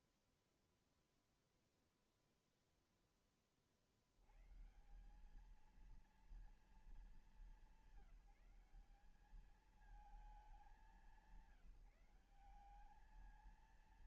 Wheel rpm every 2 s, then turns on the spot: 0, 50, 220, 190, 210, 180, 230.
none